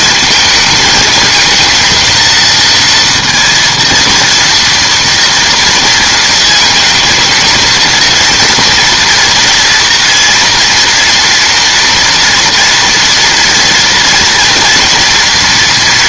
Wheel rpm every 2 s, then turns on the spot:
220, 230, 230, 220, 230, 230, 230, 230.
none